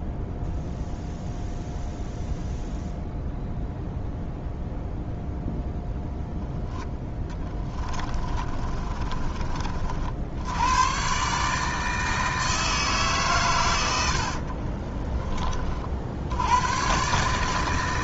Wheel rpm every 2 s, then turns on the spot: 0, 0, 0, 10, 40, 110, 160, 40, 110.
8-10 14-16